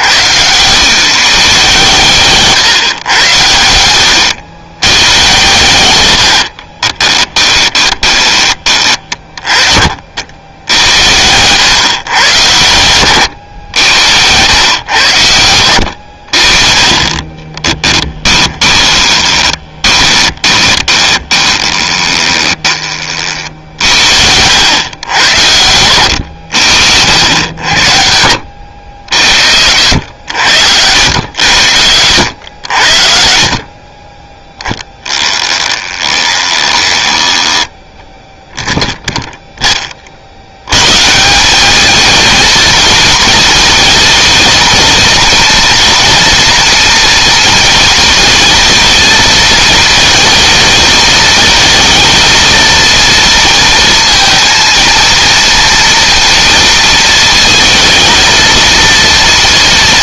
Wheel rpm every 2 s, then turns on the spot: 140, 120, 110, 20, 40, 90, 100, 90, 30, 20, 20, 30, 110, 90, 70, 80, 60, 10, 10, 0, 150, 220, 230, 230, 230, 220, 230, 230, 230, 230.
6-8 18-22